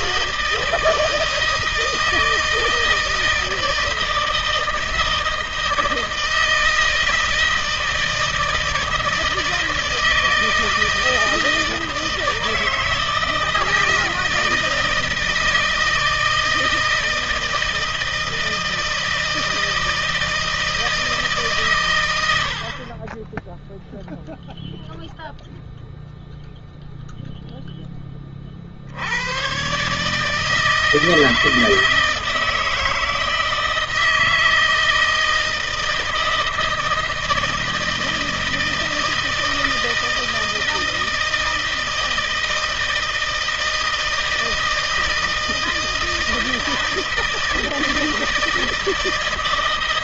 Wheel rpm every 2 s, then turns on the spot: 160, 160, 160, 160, 160, 160, 160, 160, 160, 160, 160, 30, 0, 0, 70, 160, 160, 160, 160, 160, 160, 160, 160, 160, 160.
none